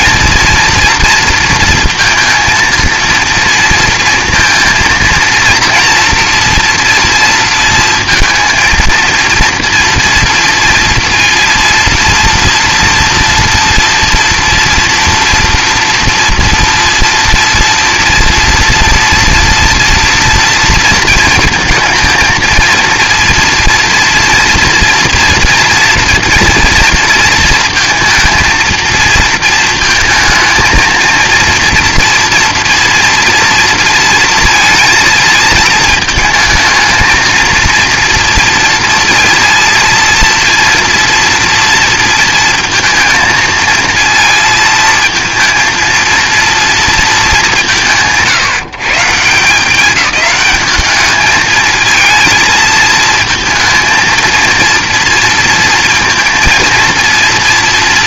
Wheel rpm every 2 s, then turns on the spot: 230, 230, 230, 230, 230, 230, 230, 230, 230, 230, 230, 230, 230, 230, 230, 220, 240, 230, 220, 230, 230, 230, 230, 230, 160, 210, 230, 230, 230.
none